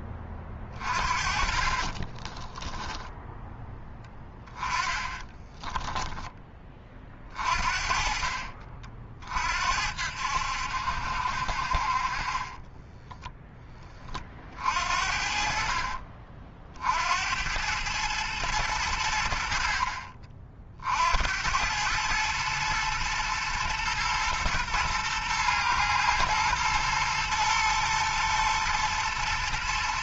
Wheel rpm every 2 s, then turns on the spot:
40, 20, 10, 20, 40, 70, 20, 50, 50, 100, 50, 110, 120, 110, 110.
0-6 12-14